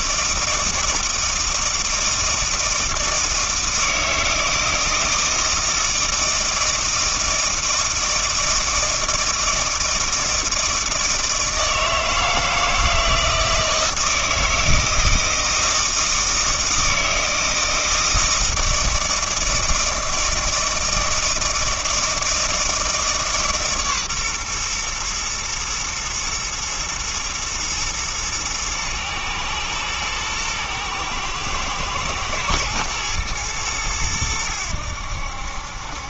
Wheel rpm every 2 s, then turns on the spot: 160, 160, 160, 160, 160, 160, 160, 160, 160, 160, 160, 160, 120, 110, 110, 110, 110, 90.
none